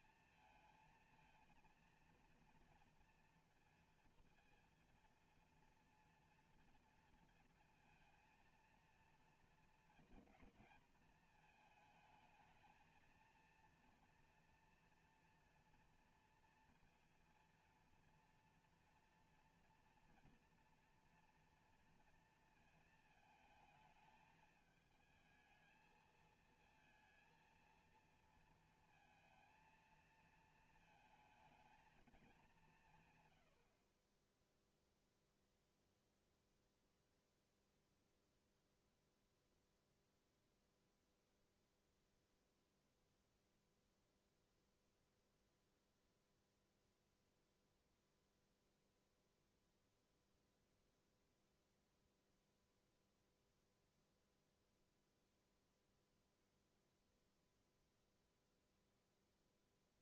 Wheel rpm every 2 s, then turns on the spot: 230, 230, 230, 230, 230, 220, 220, 230, 230, 230, 240, 230, 220, 220, 230, 220, 180, 0, 0, 0, 0, 0, 0, 0, 0, 0, 0, 0, 0, 0.
none